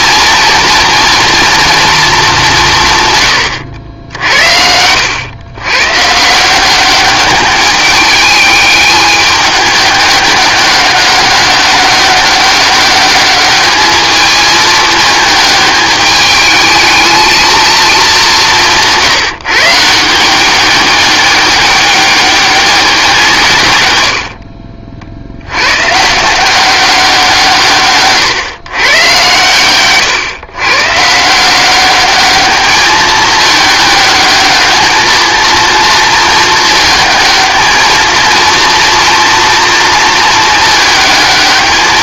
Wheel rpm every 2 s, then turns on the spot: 240, 180, 70, 180, 210, 200, 200, 220, 220, 190, 190, 200, 50, 180, 120, 120, 210, 220, 210, 230, 220.
24-26